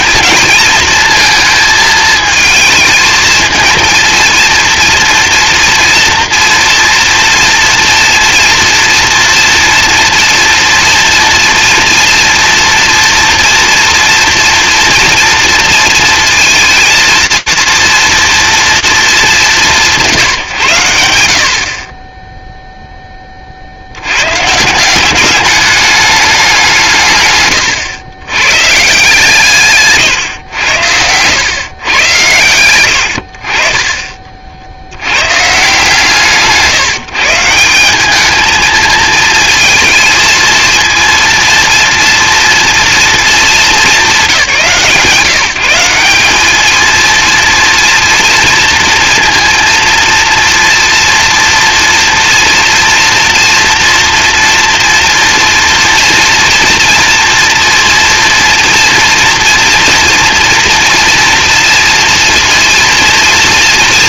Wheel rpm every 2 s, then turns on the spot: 220, 220, 230, 230, 230, 230, 240, 240, 230, 230, 130, 0, 160, 180, 140, 100, 90, 110, 160, 220, 230, 230, 150, 230, 230, 230, 230, 230, 240, 230, 230, 230.
none